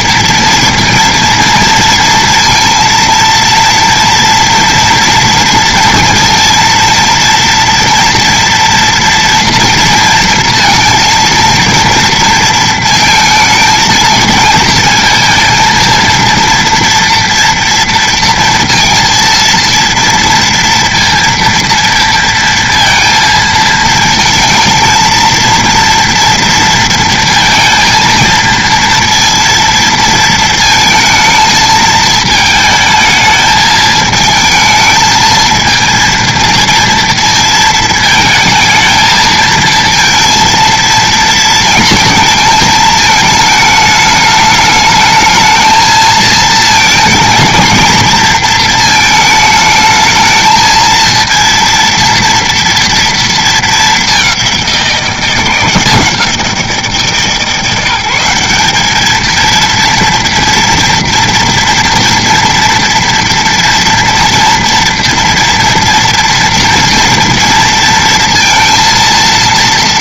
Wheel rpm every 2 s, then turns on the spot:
230, 230, 230, 230, 230, 230, 230, 230, 230, 230, 230, 230, 230, 230, 220, 220, 220, 220, 230, 220, 230, 220, 210, 220, 230, 230, 230, 180, 170, 200, 230, 230, 230, 230, 230.
none